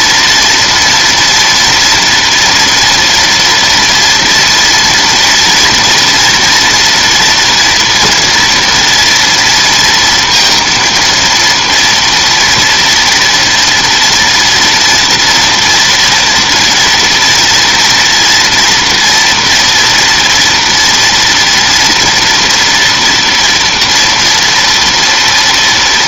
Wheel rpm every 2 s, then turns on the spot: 230, 240, 230, 230, 240, 230, 230, 230, 230, 230, 230, 230, 230.
none